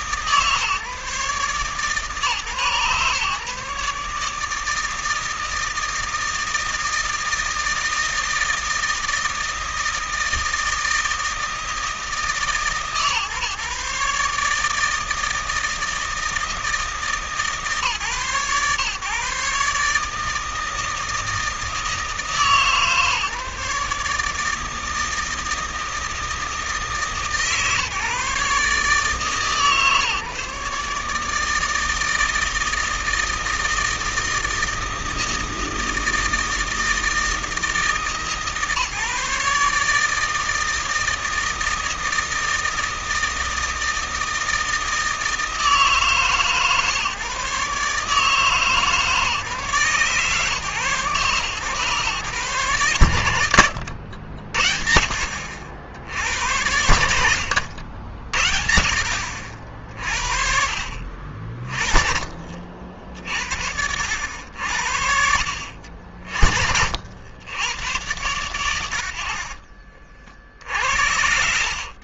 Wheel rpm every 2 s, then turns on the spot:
150, 130, 160, 160, 160, 160, 130, 160, 160, 140, 160, 150, 160, 160, 150, 150, 160, 160, 160, 150, 160, 160, 160, 140, 150, 140, 110, 70, 70, 60, 40, 50, 70, 70, 80, 70.
68-70